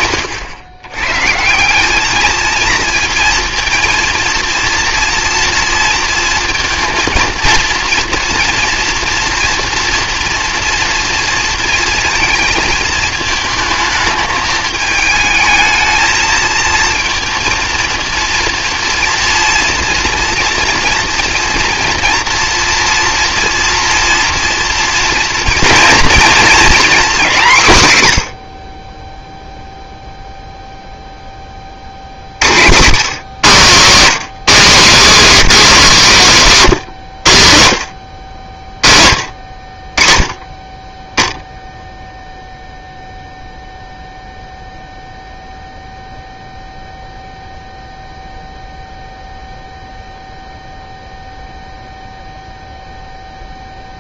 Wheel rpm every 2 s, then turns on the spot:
110, 230, 240, 230, 230, 230, 220, 210, 230, 230, 230, 230, 230, 230, 40, 0, 120, 250, 180, 50, 30, 0, 0, 0, 0, 0, 0.
none